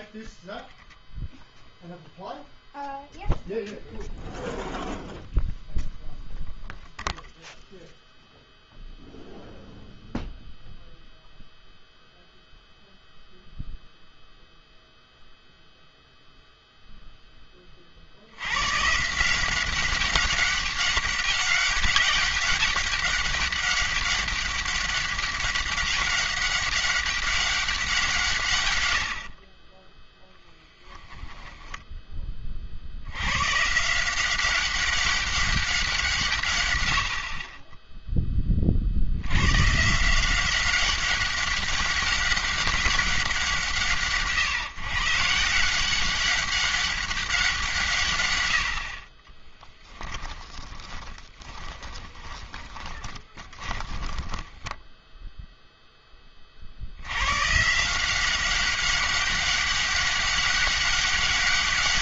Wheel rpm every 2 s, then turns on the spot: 0, 0, 0, 0, 0, 0, 0, 0, 0, 110, 200, 200, 200, 200, 120, 0, 50, 190, 110, 40, 190, 200, 140, 200, 90, 10, 10, 10, 50, 190, 200.
50-56